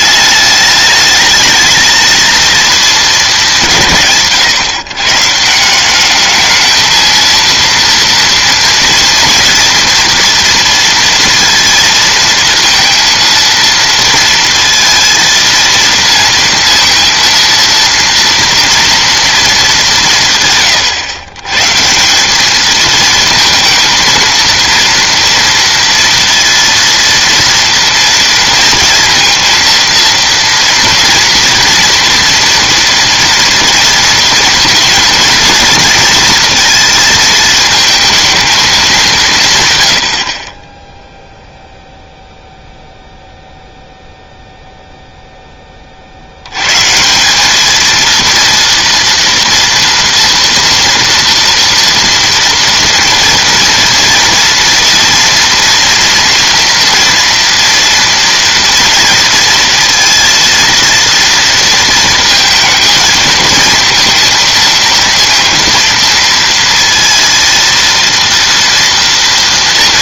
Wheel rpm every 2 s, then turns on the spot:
210, 220, 130, 220, 230, 230, 230, 230, 230, 230, 130, 210, 230, 230, 230, 230, 230, 230, 230, 220, 30, 0, 0, 110, 230, 230, 230, 230, 240, 230, 230, 220, 230, 230, 230.
none